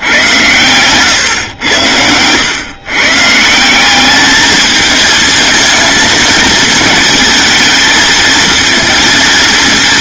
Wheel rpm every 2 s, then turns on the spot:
110, 140, 220, 220, 230.
none